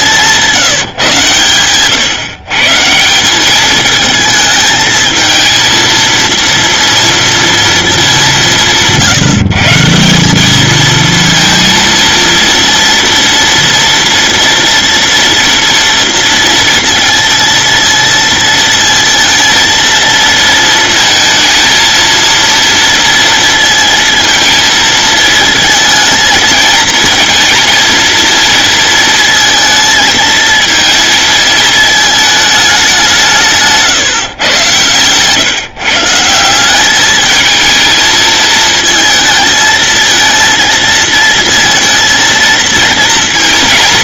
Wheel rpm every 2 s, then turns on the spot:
160, 150, 220, 230, 170, 220, 230, 230, 230, 230, 230, 230, 230, 220, 230, 230, 210, 120, 190, 220, 230, 230.
none